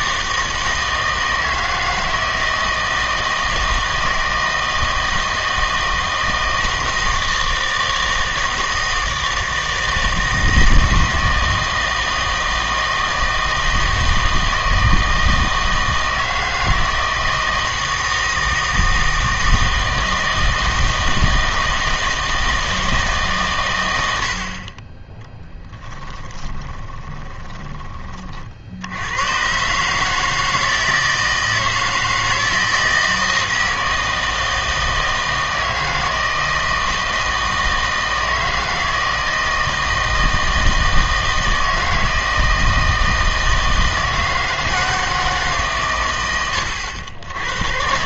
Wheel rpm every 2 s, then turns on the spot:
160, 160, 160, 160, 160, 160, 160, 160, 160, 160, 160, 160, 40, 20, 60, 160, 160, 160, 160, 160, 160, 160, 160, 100.
26-28